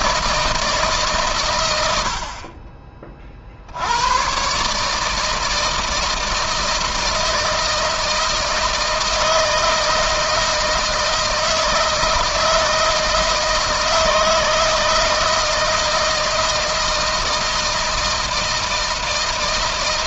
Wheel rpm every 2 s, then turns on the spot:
150, 40, 150, 160, 160, 160, 160, 160, 160, 160.
none